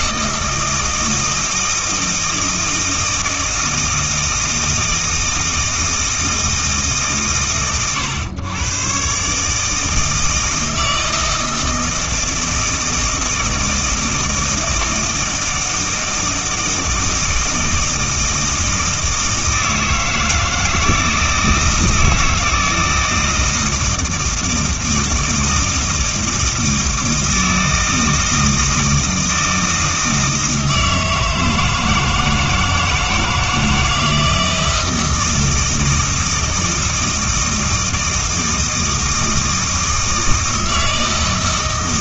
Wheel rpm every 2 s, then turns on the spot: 160, 160, 160, 150, 120, 160, 160, 160, 160, 160, 160, 160, 160, 160, 160, 160, 160, 160, 160, 160, 160.
none